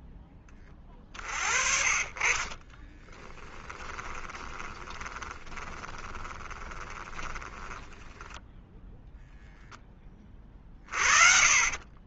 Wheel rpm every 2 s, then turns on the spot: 20, 30, 20, 20, 10, 30.
2-8